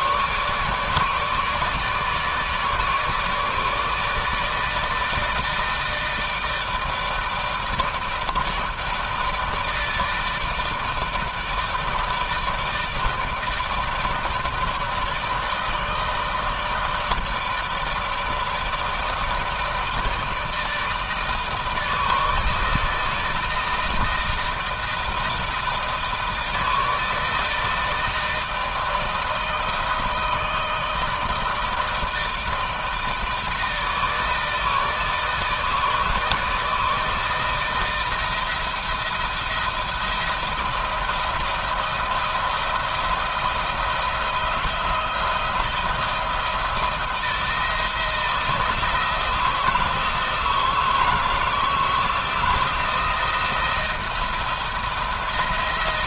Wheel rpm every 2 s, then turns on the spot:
150, 150, 160, 160, 160, 160, 160, 160, 160, 160, 160, 160, 160, 160, 160, 160, 160, 160, 160, 160, 170, 170, 160, 170, 160, 160, 170, 170.
none